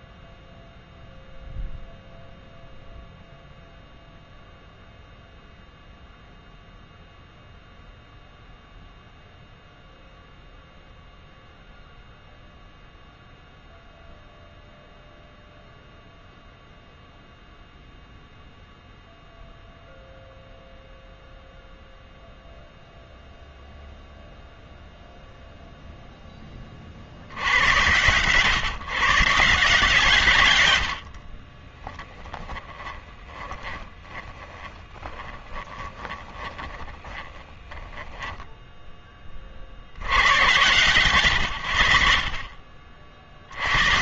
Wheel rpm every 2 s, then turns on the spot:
0, 0, 0, 0, 0, 0, 0, 0, 0, 0, 0, 0, 0, 30, 130, 110, 10, 20, 20, 10, 110, 40.
32-38